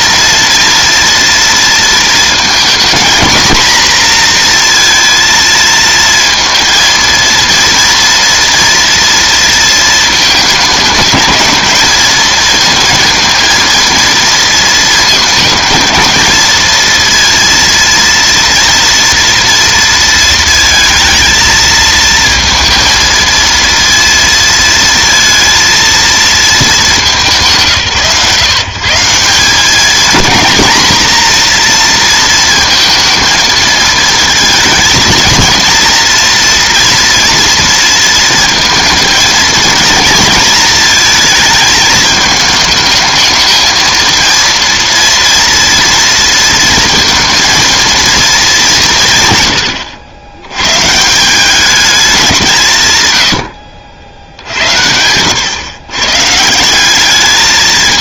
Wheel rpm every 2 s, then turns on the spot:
230, 220, 230, 230, 230, 210, 230, 230, 220, 230, 220, 230, 230, 210, 150, 240, 230, 230, 230, 230, 230, 220, 230, 230, 210, 110, 170, 70, 170.
none